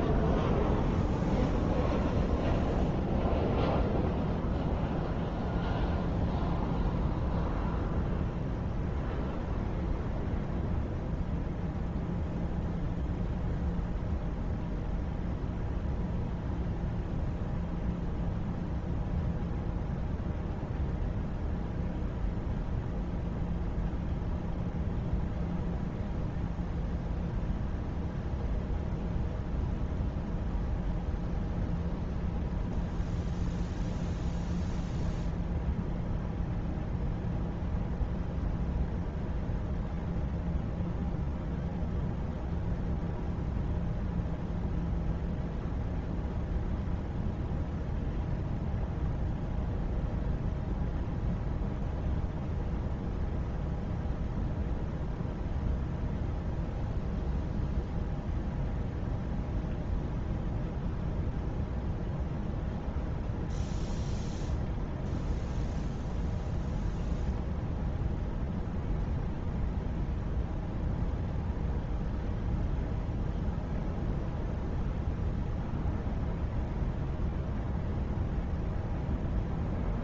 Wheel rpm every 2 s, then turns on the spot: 0, 0, 0, 0, 0, 0, 0, 0, 0, 0, 0, 0, 0, 0, 0, 0, 0, 0, 0, 0, 0, 0, 0, 0, 0, 0, 0, 0, 0, 0, 0, 0, 0, 0, 0, 0, 0, 0, 0, 0.
none